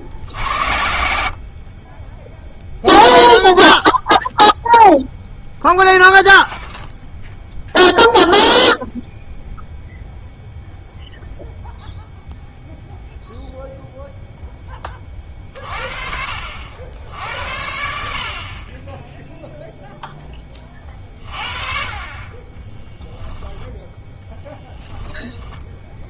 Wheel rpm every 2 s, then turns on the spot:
70, 0, 0, 0, 0, 0, 0, 20, 70, 20, 30, 10, 10.
22-26